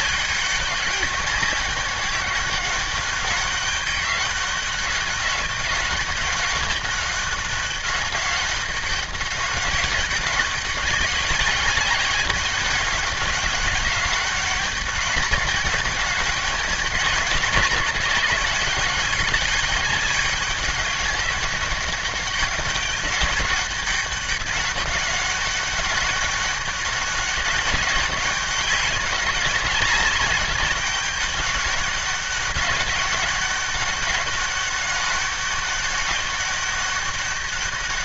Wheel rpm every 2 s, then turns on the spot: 200, 200, 190, 200, 200, 200, 200, 200, 200, 190, 200, 200, 200, 200, 200, 200, 200, 200, 200.
none